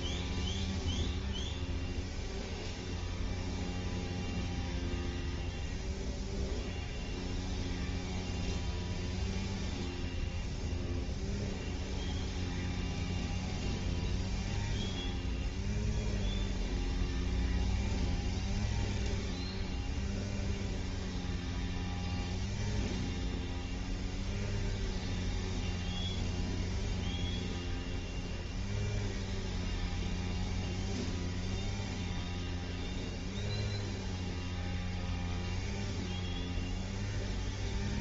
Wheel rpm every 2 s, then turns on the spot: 0, 0, 0, 0, 0, 0, 0, 0, 0, 0, 0, 0, 0, 0, 0, 0, 0, 0, 0.
none